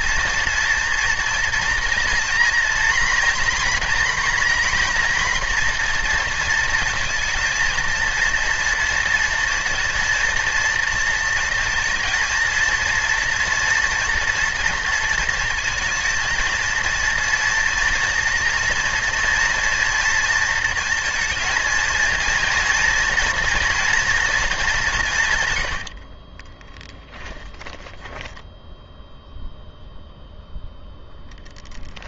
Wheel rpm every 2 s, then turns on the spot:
230, 230, 240, 220, 230, 230, 230, 230, 230, 230, 230, 230, 190, 10, 0, 0.
26-28